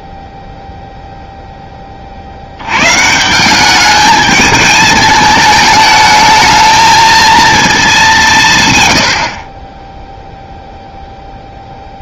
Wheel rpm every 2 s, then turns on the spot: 0, 110, 210, 220, 100, 0.
none